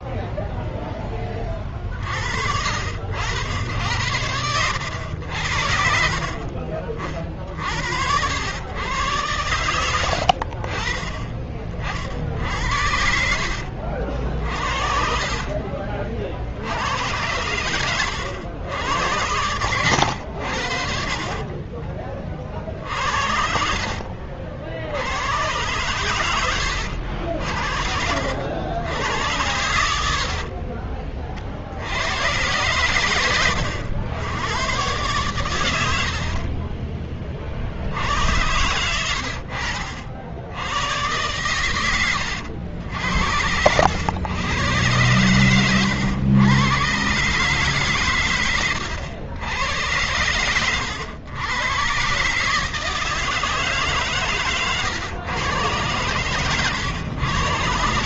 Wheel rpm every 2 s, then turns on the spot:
0, 40, 90, 50, 70, 90, 40, 60, 50, 100, 100, 30, 60, 110, 60, 80, 90, 90, 80, 80, 70, 90, 90, 110, 130, 100, 130, 140, 120.
6-8 30-32 36-38 50-52